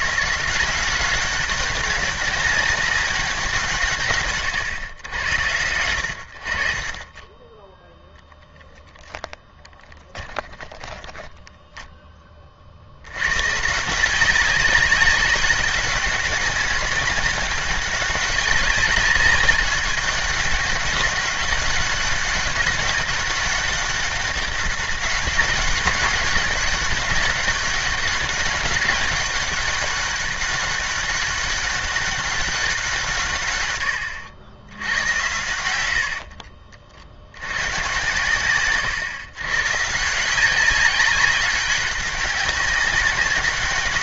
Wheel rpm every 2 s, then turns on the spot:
170, 200, 120, 60, 10, 20, 40, 200, 200, 200, 190, 200, 200, 200, 200, 200, 190, 100, 50, 130, 190, 200.
10-12